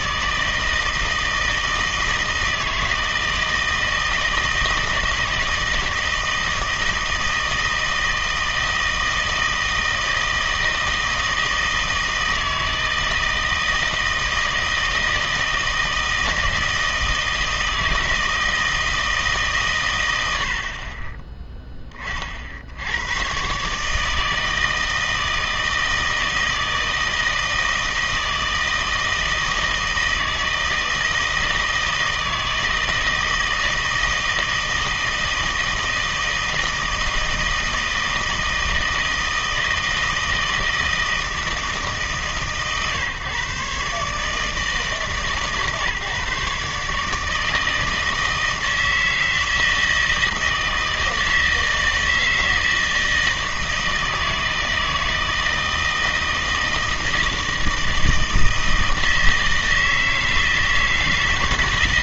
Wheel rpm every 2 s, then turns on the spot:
160, 160, 160, 160, 160, 160, 160, 160, 160, 160, 50, 70, 160, 160, 160, 160, 160, 160, 160, 160, 160, 140, 160, 150, 160, 160, 160, 160, 160, 160, 160.
none